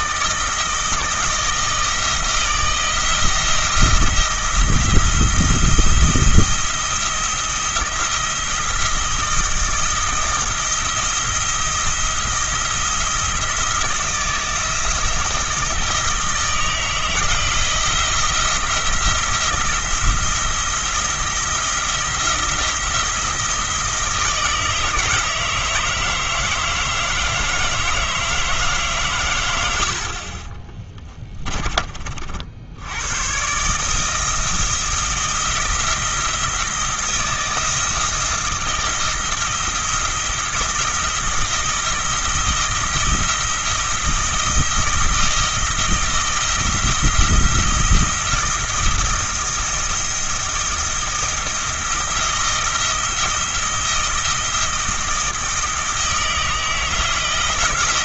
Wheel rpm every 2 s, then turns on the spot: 160, 170, 170, 170, 170, 170, 170, 170, 160, 170, 170, 170, 160, 160, 150, 20, 80, 170, 170, 170, 170, 160, 160, 160, 170, 170, 170, 170, 160.
30-32